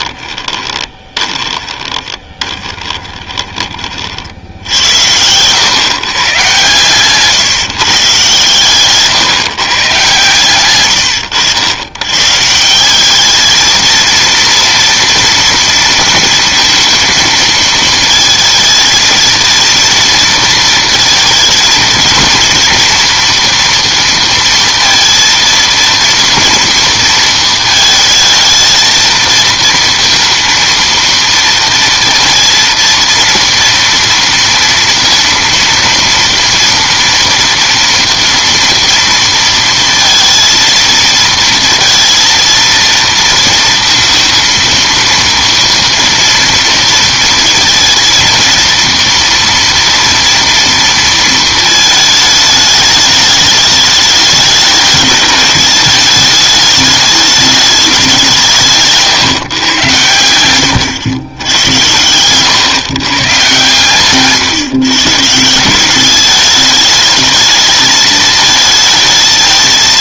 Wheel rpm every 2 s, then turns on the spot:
20, 20, 90, 130, 140, 110, 180, 230, 230, 220, 220, 230, 230, 230, 220, 230, 230, 230, 230, 230, 230, 230, 230, 230, 230, 230, 210, 210, 210, 160, 90, 130, 140, 220, 220.
0-6